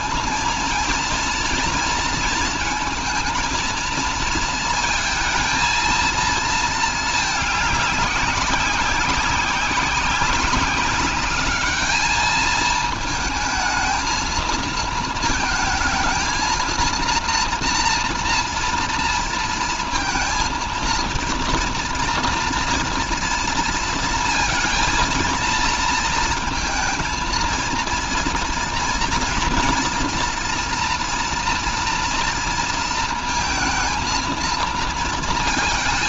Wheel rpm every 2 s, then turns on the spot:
230, 230, 220, 220, 190, 200, 220, 230, 230, 230, 230, 230, 230, 230, 230, 230, 230, 230.
none